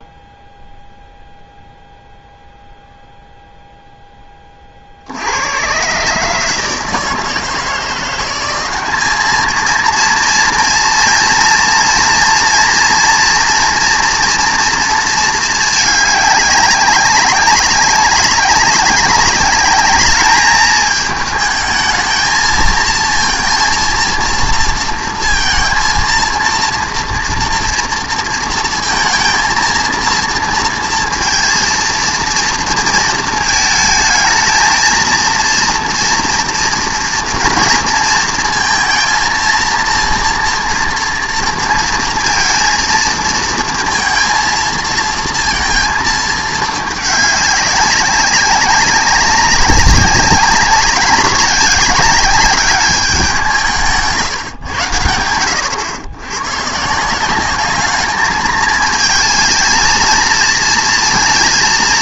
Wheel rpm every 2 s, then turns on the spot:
0, 0, 30, 160, 200, 230, 240, 230, 200, 190, 210, 230, 230, 230, 230, 230, 230, 230, 230, 230, 230, 230, 230, 210, 190, 190, 200, 110, 130, 220, 230.
none